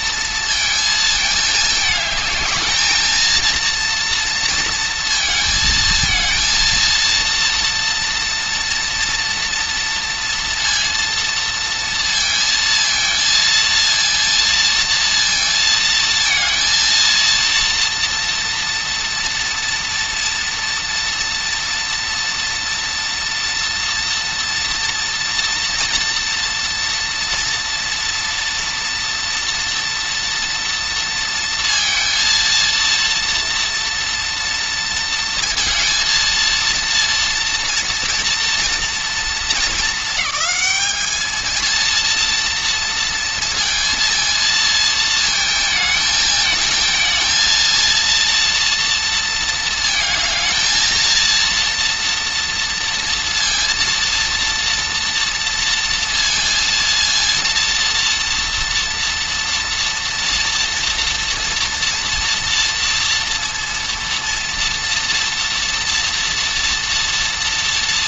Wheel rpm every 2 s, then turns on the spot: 220, 220, 230, 230, 230, 230, 230, 230, 230, 240, 230, 230, 230, 230, 240, 230, 230, 230, 230, 230, 210, 230, 230, 220, 230, 230, 230, 230, 230, 230, 240, 230, 230, 230.
none